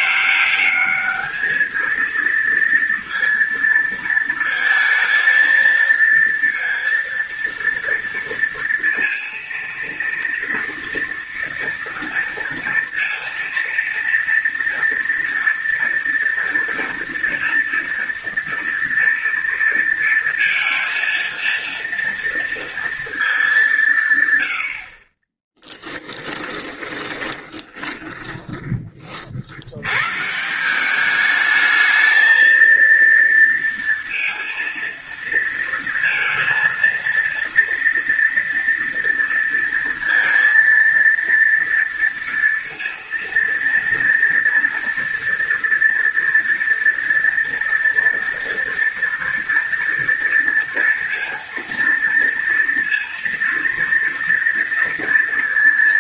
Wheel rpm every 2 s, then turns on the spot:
210, 230, 230, 230, 230, 230, 230, 230, 230, 230, 230, 230, 70, 20, 30, 170, 230, 230, 230, 230, 230, 230, 230, 230, 230, 230, 230, 230.
26-28